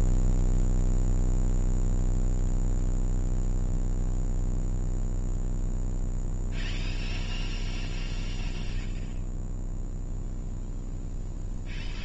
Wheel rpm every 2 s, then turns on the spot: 0, 0, 0, 0, 0, 0.
none